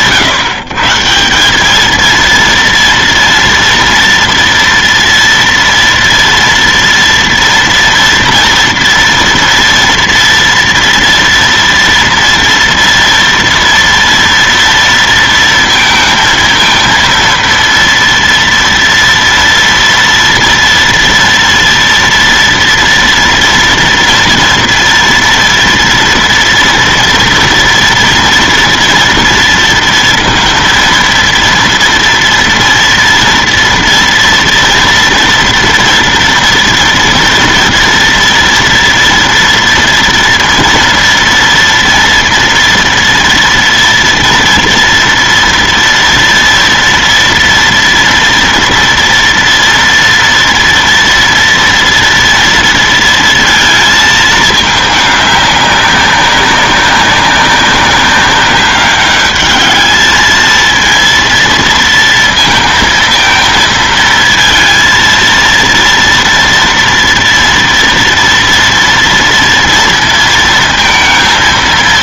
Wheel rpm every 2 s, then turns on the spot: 160, 230, 230, 230, 230, 230, 230, 230, 230, 240, 230, 230, 240, 230, 230, 230, 230, 230, 230, 230, 230, 230, 230, 230, 230, 230, 230, 210, 200, 200, 230, 230, 230, 230, 230, 230.
none